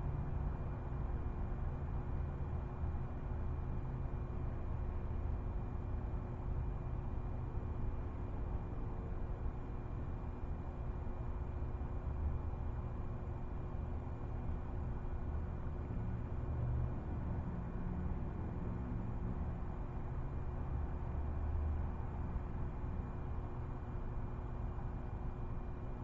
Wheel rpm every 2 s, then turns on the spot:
0, 0, 0, 0, 0, 0, 0, 0, 0, 0, 0, 0, 0.
none